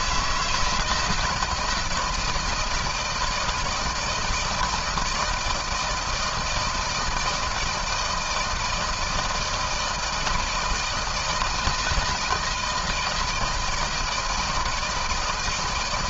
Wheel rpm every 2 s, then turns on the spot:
170, 160, 160, 160, 160, 160, 160, 160.
none